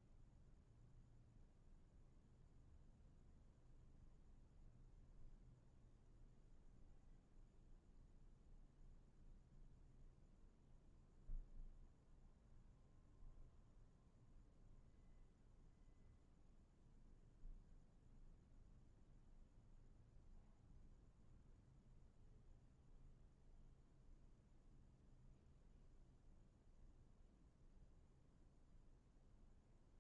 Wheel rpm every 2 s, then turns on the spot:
0, 0, 0, 0, 0, 0, 0, 0, 0, 0, 0, 0, 0, 0, 0.
none